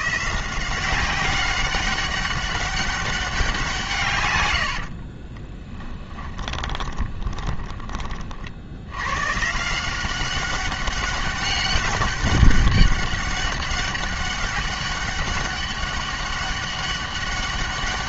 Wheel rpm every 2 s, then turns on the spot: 170, 190, 90, 20, 70, 200, 200, 200, 200.
4-8